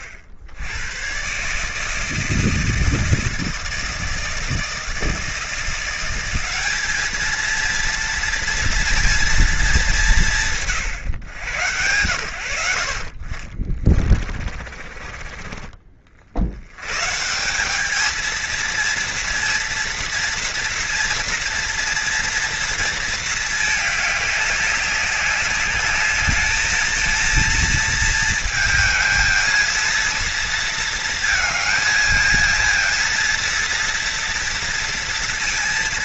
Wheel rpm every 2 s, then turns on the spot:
90, 160, 160, 190, 230, 170, 80, 40, 80, 230, 230, 230, 200, 220, 220, 230, 230, 230.
12-16